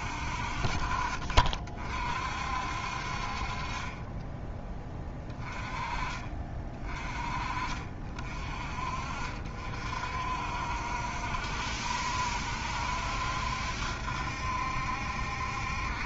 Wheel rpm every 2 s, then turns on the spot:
50, 50, 20, 30, 50, 70, 70, 70.
0-2